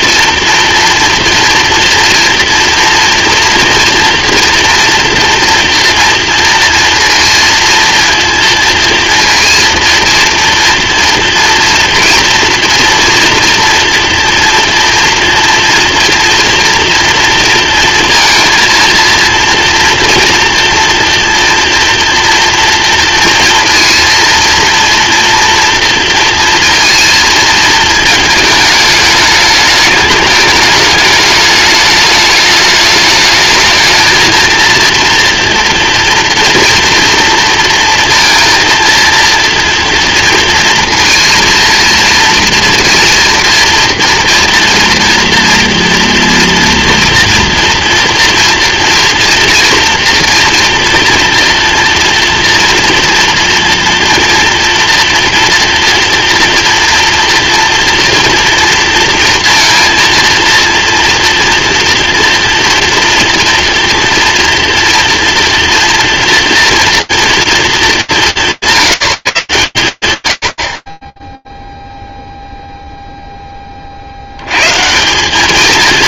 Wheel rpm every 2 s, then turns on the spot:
240, 230, 230, 230, 230, 230, 230, 230, 230, 230, 240, 230, 240, 230, 220, 210, 210, 230, 230, 230, 230, 230, 240, 240, 230, 230, 230, 230, 230, 230, 230, 240, 230, 230, 140, 60, 0, 110.
none